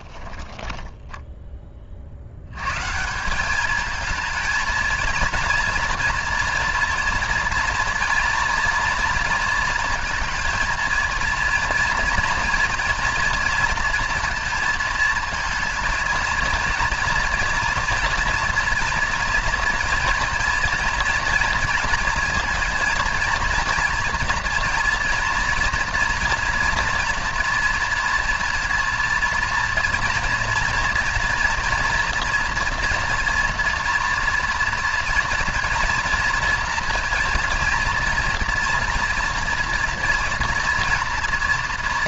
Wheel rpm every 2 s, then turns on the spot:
20, 120, 230, 230, 230, 230, 230, 230, 230, 230, 230, 230, 230, 230, 230, 230, 230, 240, 230, 230, 230.
0-2